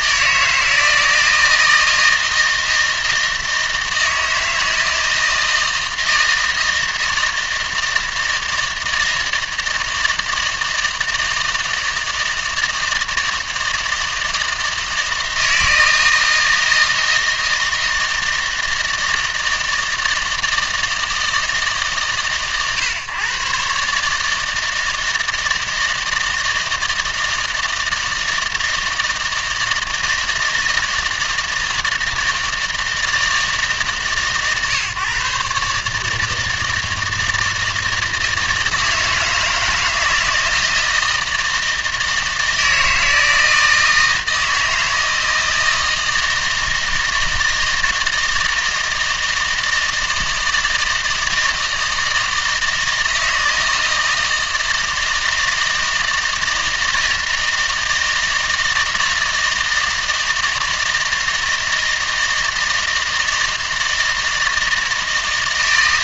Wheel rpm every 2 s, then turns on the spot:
160, 160, 160, 160, 160, 160, 160, 160, 160, 160, 160, 120, 160, 160, 160, 160, 160, 140, 160, 160, 160, 160, 160, 160, 160, 160, 160, 160, 160, 160, 160, 160, 160.
none